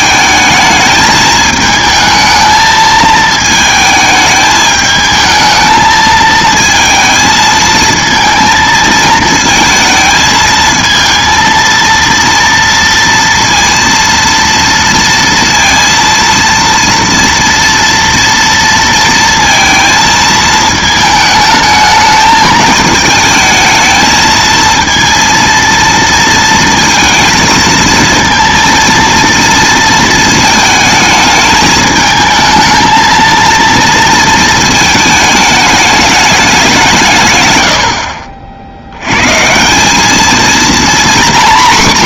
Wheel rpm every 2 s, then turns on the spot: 220, 220, 220, 220, 220, 220, 230, 230, 230, 230, 220, 220, 230, 230, 230, 220, 220, 220, 190, 70, 240.
none